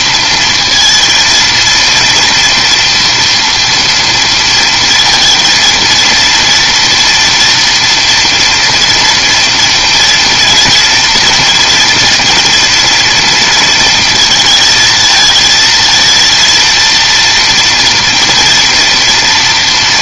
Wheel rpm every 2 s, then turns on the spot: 230, 230, 230, 230, 240, 230, 230, 220, 230, 240.
none